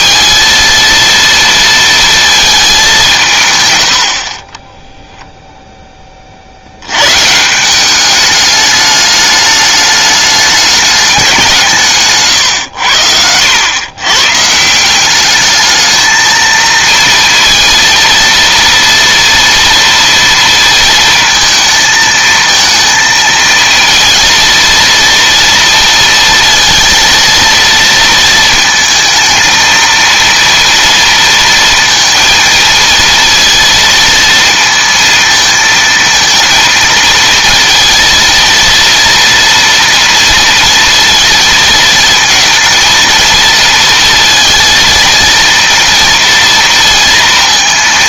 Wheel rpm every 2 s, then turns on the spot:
230, 220, 30, 70, 210, 210, 110, 150, 230, 230, 230, 220, 230, 230, 220, 230, 230, 230, 230, 230, 240, 230, 230, 230.
4-6